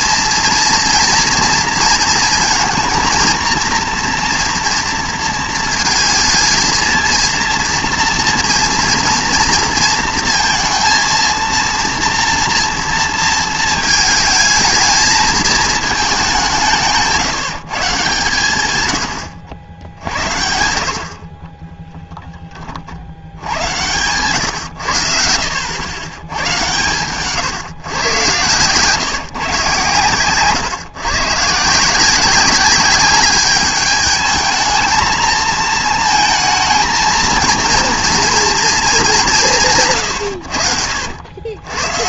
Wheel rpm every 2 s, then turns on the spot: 230, 230, 230, 220, 230, 230, 230, 220, 180, 120, 70, 20, 110, 120, 120, 130, 200, 220, 230, 230, 100.
none